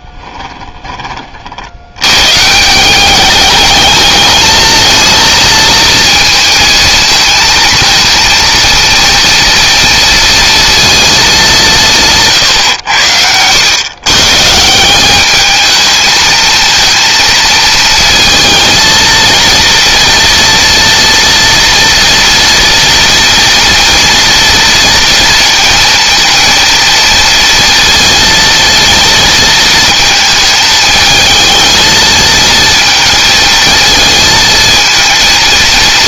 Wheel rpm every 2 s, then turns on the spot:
10, 170, 220, 230, 230, 230, 100, 170, 230, 230, 230, 230, 230, 230, 230, 220, 230, 230.
none